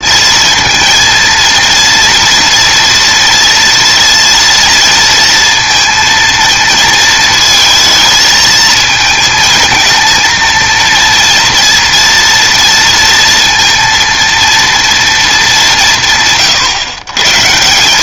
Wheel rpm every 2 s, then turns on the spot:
230, 230, 230, 220, 220, 230, 230, 230, 130.
none